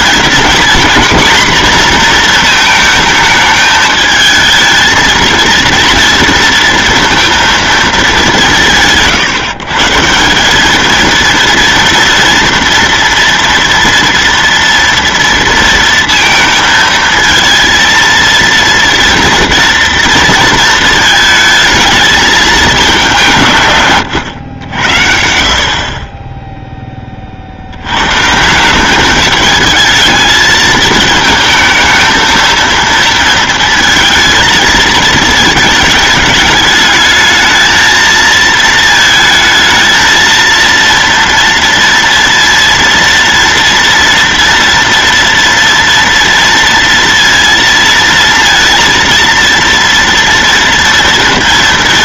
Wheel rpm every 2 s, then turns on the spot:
230, 230, 220, 230, 160, 210, 230, 230, 220, 230, 220, 210, 90, 10, 170, 220, 230, 220, 210, 220, 230, 230, 230, 230, 230, 230.
none